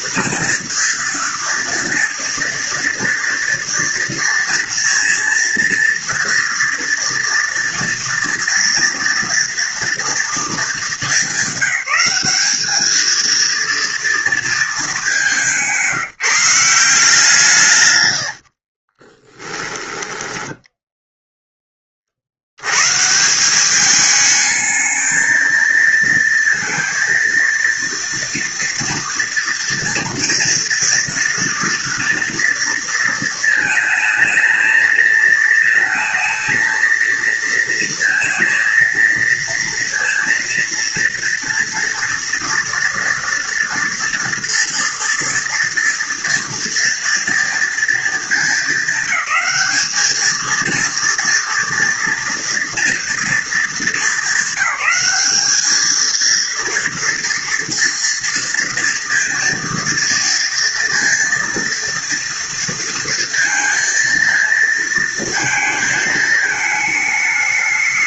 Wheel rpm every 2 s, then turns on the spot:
230, 240, 230, 230, 230, 220, 220, 210, 170, 40, 0, 140, 220, 230, 230, 230, 230, 220, 220, 230, 230, 230, 230, 230, 200, 230, 230, 200, 230, 230, 230, 230, 230, 210.
18-20